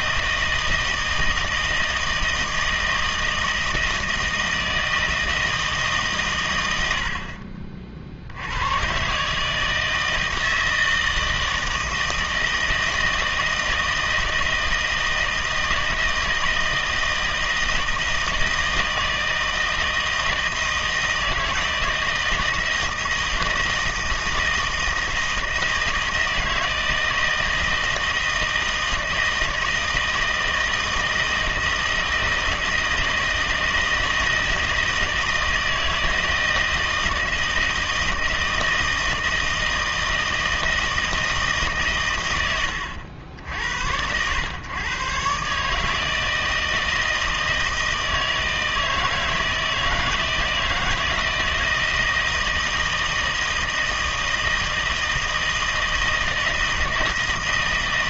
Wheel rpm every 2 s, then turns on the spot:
160, 160, 160, 110, 80, 160, 160, 160, 160, 160, 160, 160, 160, 160, 160, 160, 160, 160, 160, 160, 160, 110, 110, 160, 160, 160, 160, 160, 160.
none